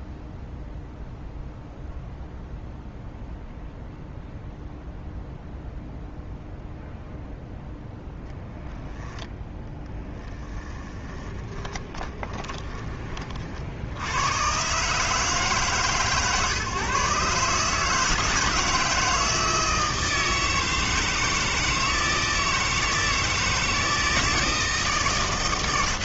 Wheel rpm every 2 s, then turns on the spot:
0, 0, 0, 0, 10, 20, 20, 140, 130, 160, 160, 160, 160.
10-12